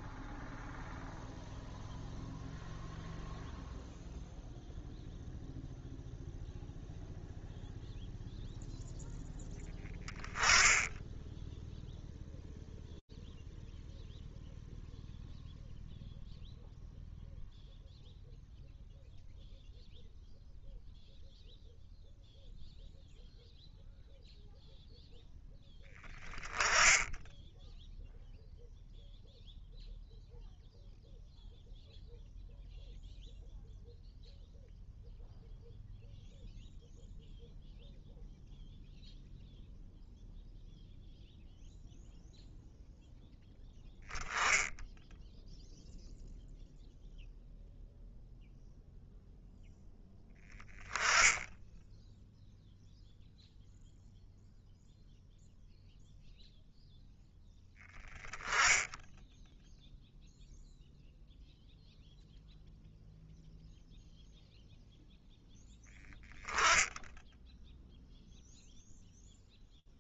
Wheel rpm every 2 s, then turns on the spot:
0, 0, 0, 0, 0, 10, 0, 0, 0, 0, 0, 0, 0, 20, 0, 0, 0, 0, 0, 0, 0, 0, 10, 0, 0, 10, 0, 0, 0, 10, 0, 0, 0, 0, 0.
none